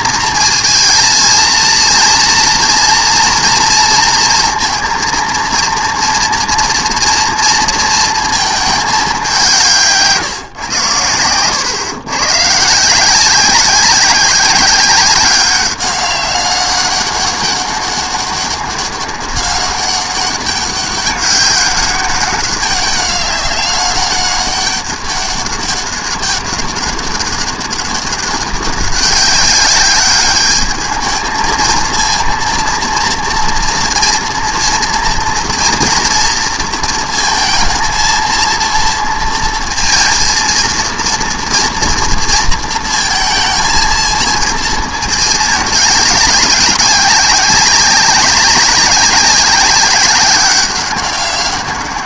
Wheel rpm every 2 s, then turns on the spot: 220, 230, 230, 230, 220, 140, 140, 190, 200, 200, 200, 200, 200, 200, 200, 210, 230, 230, 230, 230, 230, 230, 230, 200, 200, 200.
none